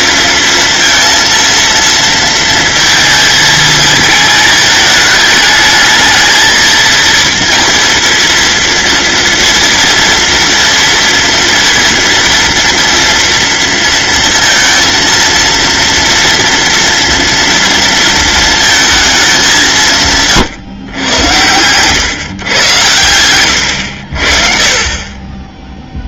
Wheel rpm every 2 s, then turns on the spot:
230, 220, 220, 230, 230, 240, 230, 230, 230, 230, 120, 100, 40.
none